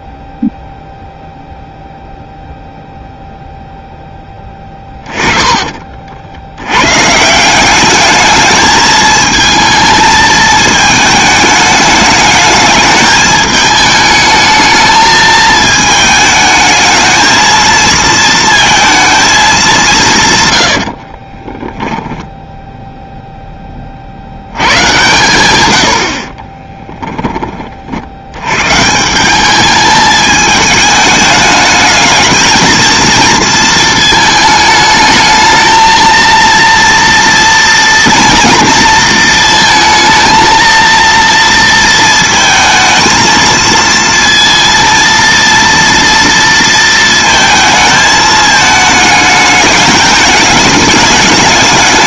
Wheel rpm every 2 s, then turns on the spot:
0, 0, 20, 100, 220, 220, 210, 220, 220, 220, 90, 0, 100, 20, 140, 220, 230, 220, 230, 230, 230, 220, 230, 230, 220, 210.
4-6 20-22 26-28